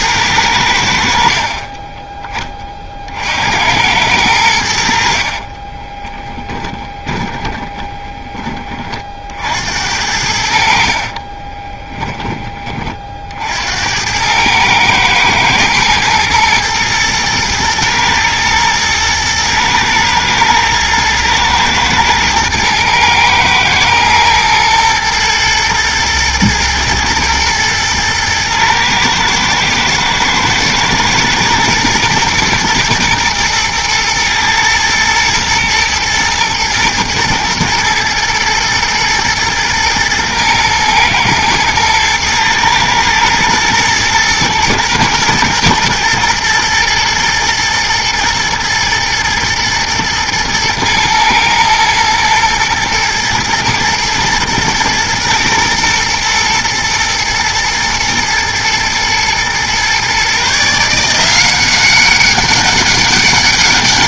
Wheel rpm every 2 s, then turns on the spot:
100, 20, 90, 20, 20, 70, 20, 100, 120, 120, 110, 110, 110, 120, 110, 120, 120, 110, 110, 110, 120, 110, 110, 120, 110, 110, 120, 110, 120, 120, 140, 200.
6-8